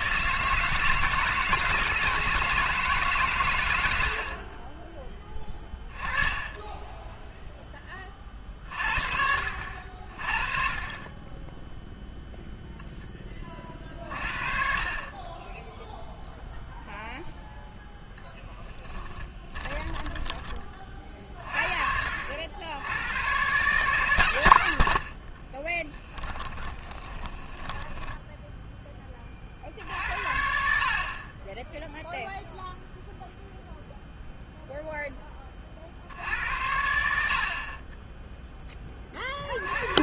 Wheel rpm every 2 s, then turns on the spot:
160, 160, 30, 10, 50, 30, 0, 40, 0, 10, 30, 90, 90, 20, 10, 50, 0, 0, 80, 20.
6-8 18-20 26-28